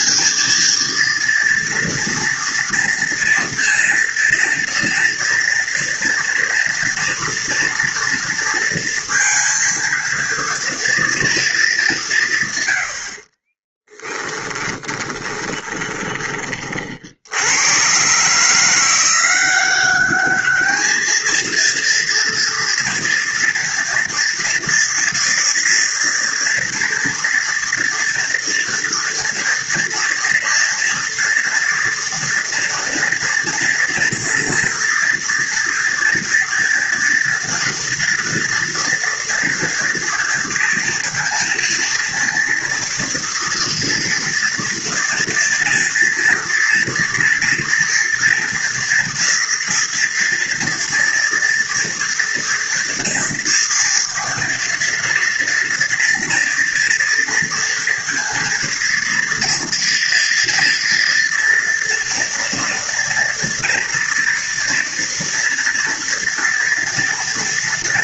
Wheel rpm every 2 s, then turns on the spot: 220, 230, 230, 240, 230, 230, 120, 10, 40, 160, 210, 230, 230, 240, 240, 230, 230, 230, 230, 230, 230, 230, 230, 230, 230, 230, 240, 240, 230, 230, 240, 230, 230, 230.
14-16